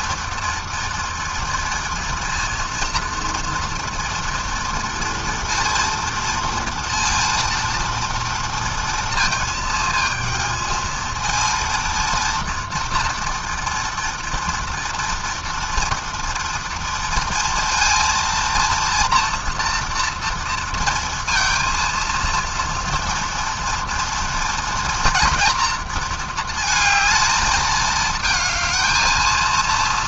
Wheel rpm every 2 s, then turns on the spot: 230, 240, 230, 230, 230, 230, 230, 240, 230, 240, 230, 230, 230, 220, 230.
none